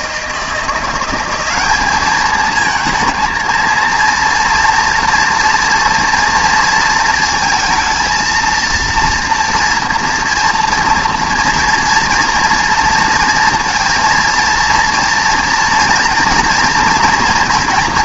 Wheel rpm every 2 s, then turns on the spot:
170, 220, 240, 230, 230, 230, 230, 230, 240.
none